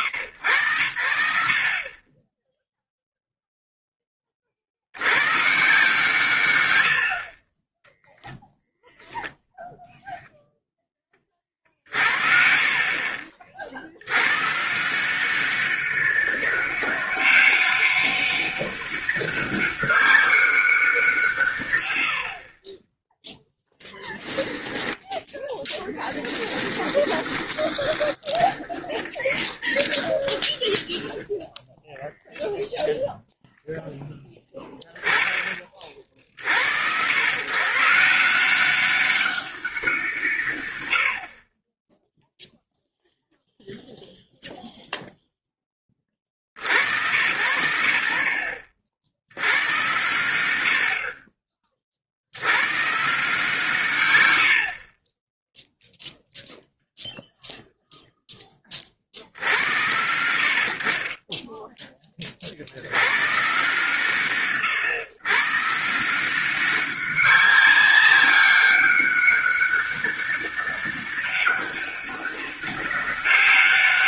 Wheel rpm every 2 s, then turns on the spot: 120, 10, 40, 120, 0, 10, 40, 150, 200, 200, 190, 30, 10, 30, 30, 20, 0, 0, 90, 190, 80, 0, 0, 100, 40, 70, 130, 80, 0, 10, 60, 70, 130, 190, 200, 200, 200.
22-32